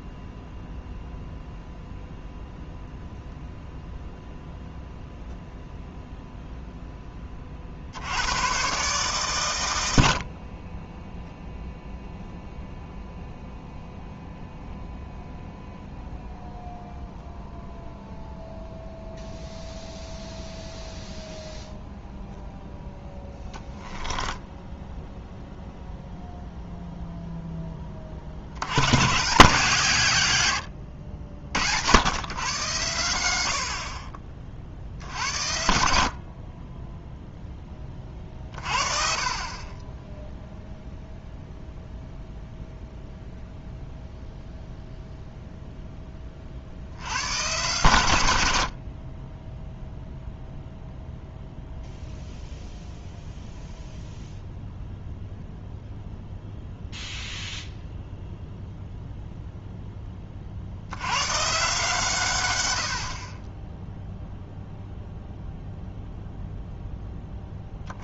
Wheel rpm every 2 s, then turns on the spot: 0, 0, 0, 0, 130, 20, 0, 0, 0, 0, 0, 0, 10, 0, 130, 90, 110, 60, 10, 40, 0, 0, 0, 60, 80, 0, 0, 0, 0, 0, 70, 80, 0, 0.
24-26